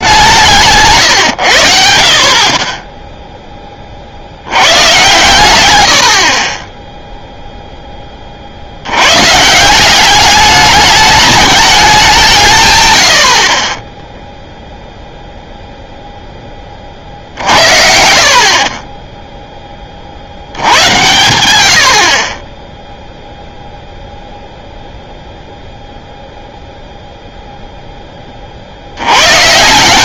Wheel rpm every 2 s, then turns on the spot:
170, 30, 90, 30, 50, 200, 150, 10, 20, 30, 80, 20, 0, 0, 40.
14-16 18-20